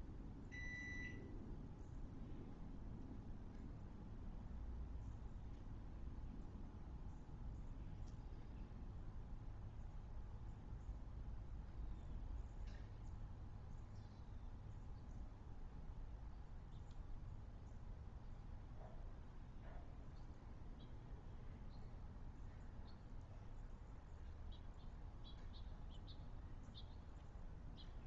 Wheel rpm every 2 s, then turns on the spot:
0, 0, 0, 0, 0, 0, 0, 0, 0, 0, 0, 0, 0, 0.
none